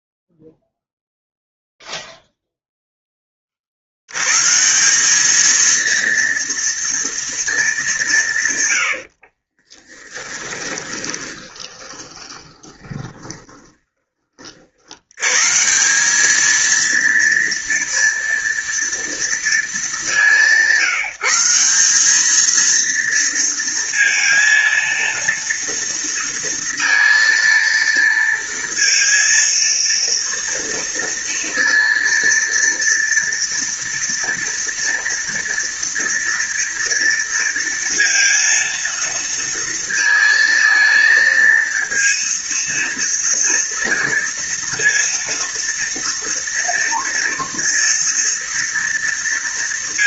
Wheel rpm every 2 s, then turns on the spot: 0, 0, 140, 230, 120, 20, 20, 50, 220, 230, 190, 220, 230, 230, 230, 230, 230, 230, 230, 230, 230, 230, 230, 230, 230.
10-14